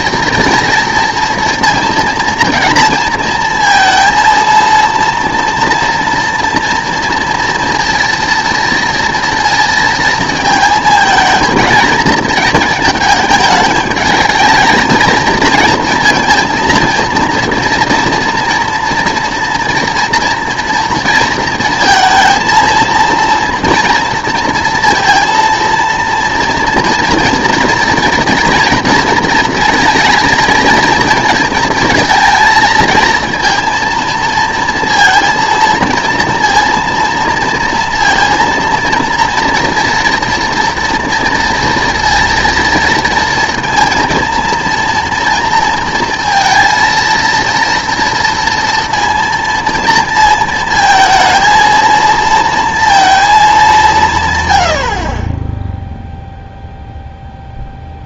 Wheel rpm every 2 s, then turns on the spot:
230, 230, 230, 240, 230, 230, 220, 220, 230, 230, 230, 230, 230, 240, 230, 230, 230, 230, 230, 230, 230, 230, 230, 230, 230, 230, 230, 80, 0.
none